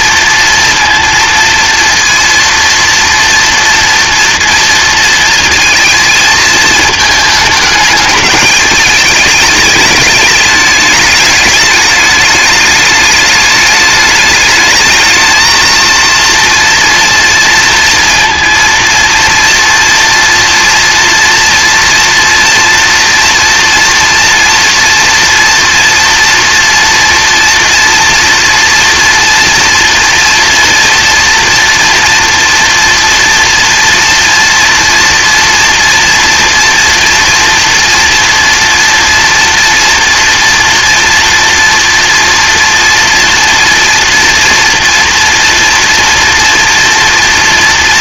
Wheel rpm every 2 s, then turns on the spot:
230, 230, 230, 220, 210, 210, 210, 220, 230, 230, 240, 240, 230, 230, 230, 230, 230, 230, 230, 240, 240, 230, 230, 230.
none